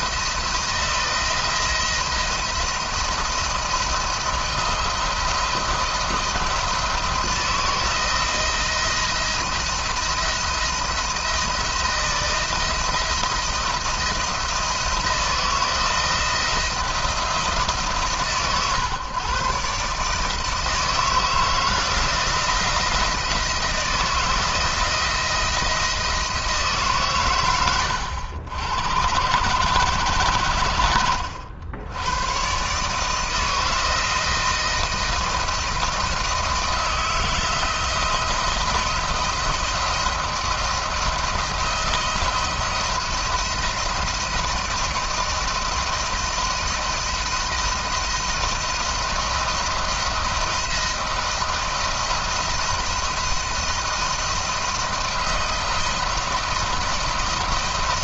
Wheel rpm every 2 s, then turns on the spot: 170, 170, 160, 160, 170, 170, 170, 170, 170, 130, 160, 160, 170, 140, 90, 90, 150, 170, 160, 170, 170, 170, 170, 160, 160, 170, 160, 160, 160.
none